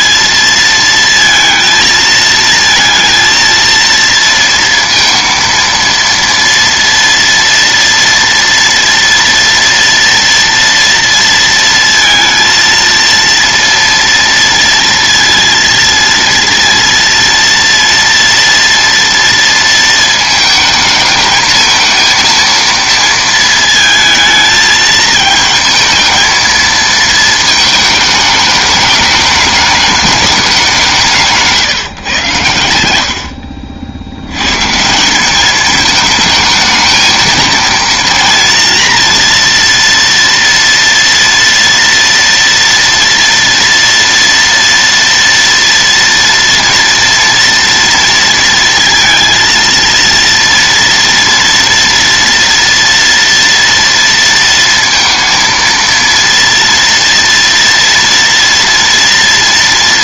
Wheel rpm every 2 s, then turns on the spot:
230, 230, 230, 230, 230, 230, 230, 230, 230, 230, 220, 230, 220, 230, 210, 200, 80, 150, 220, 240, 230, 230, 230, 230, 230, 230, 230, 230, 230, 230.
none